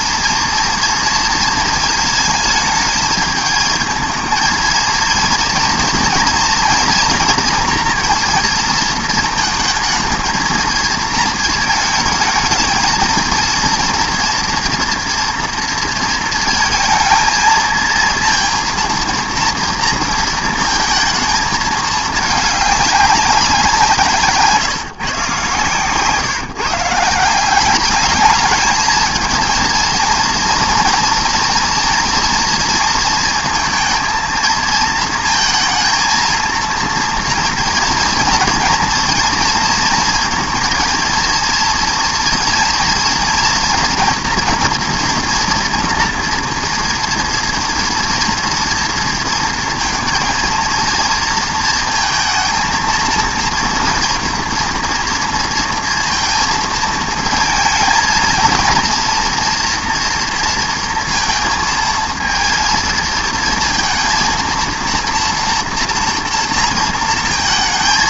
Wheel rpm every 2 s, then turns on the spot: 230, 220, 230, 230, 230, 230, 220, 230, 230, 230, 230, 210, 150, 150, 220, 230, 230, 220, 230, 230, 230, 230, 240, 230, 230, 230, 230, 240, 220, 230, 230, 230, 230, 230.
none